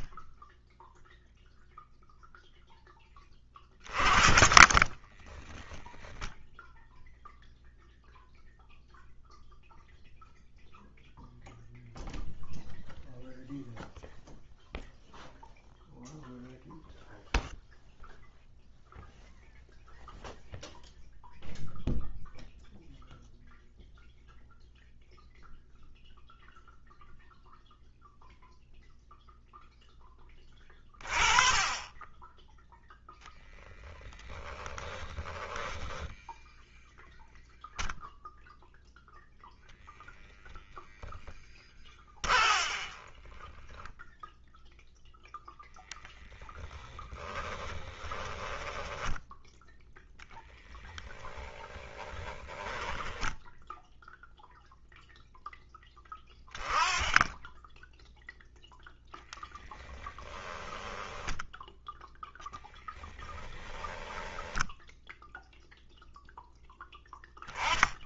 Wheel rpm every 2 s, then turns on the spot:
0, 20, 20, 0, 0, 0, 0, 0, 0, 0, 0, 0, 0, 0, 0, 20, 0, 30, 0, 0, 0, 30, 0, 10, 10, 10, 10, 0, 10, 0, 10, 10, 0, 10.
4-6 34-36 42-44 46-54 60-62